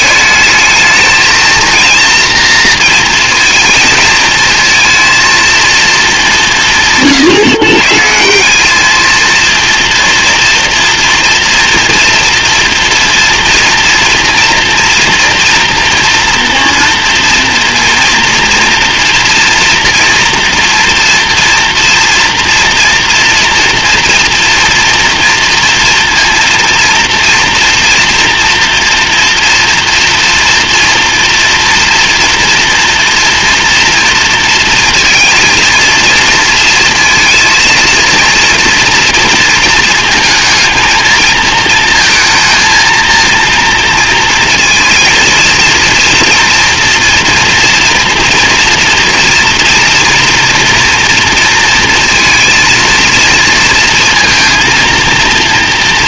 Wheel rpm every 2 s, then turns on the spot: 220, 230, 230, 150, 200, 230, 230, 230, 230, 230, 230, 230, 230, 240, 240, 230, 240, 230, 220, 230, 220, 230, 230, 230, 230, 230, 230, 230.
none